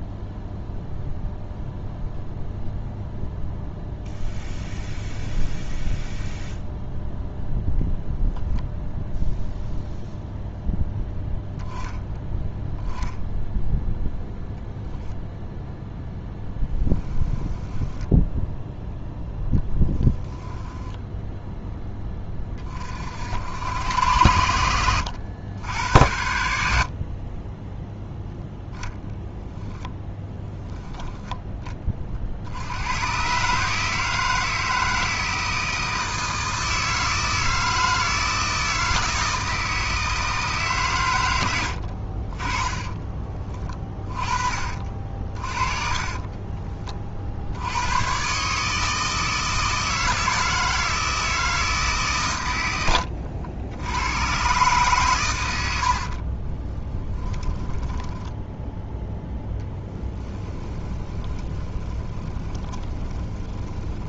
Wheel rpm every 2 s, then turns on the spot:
0, 0, 0, 0, 0, 0, 0, 10, 10, 0, 10, 40, 90, 60, 0, 10, 100, 160, 160, 160, 130, 20, 40, 30, 150, 160, 90, 130, 30, 10, 20, 20.
16-18 20-22 26-28 42-44 52-54 56-58 60-64